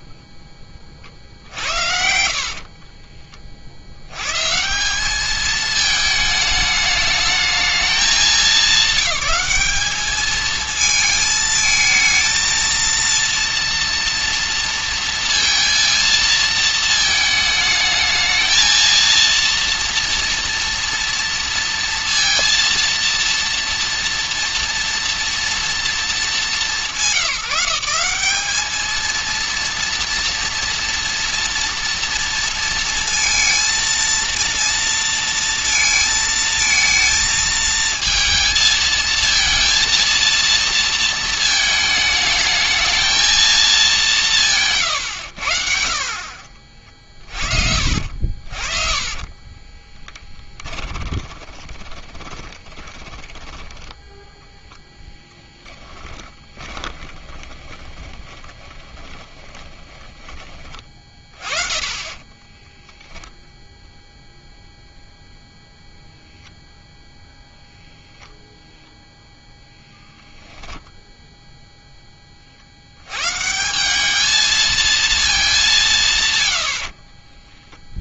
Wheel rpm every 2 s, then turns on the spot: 20, 50, 150, 210, 210, 220, 220, 230, 220, 220, 230, 230, 230, 200, 210, 230, 230, 230, 220, 230, 230, 220, 140, 40, 40, 20, 20, 0, 20, 20, 30, 10, 0, 0, 0, 0, 50, 220, 100.
2-4 44-54 56-60 62-64